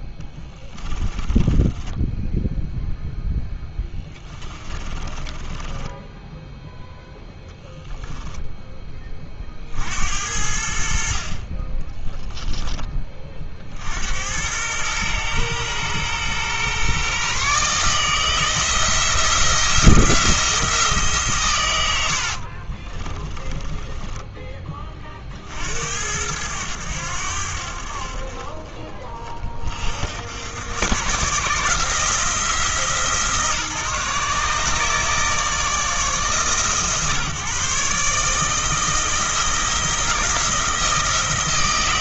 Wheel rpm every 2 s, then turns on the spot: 20, 0, 20, 0, 30, 40, 40, 110, 140, 170, 130, 20, 50, 80, 30, 120, 160, 150, 140, 160, 160.
4-6 10-12 22-24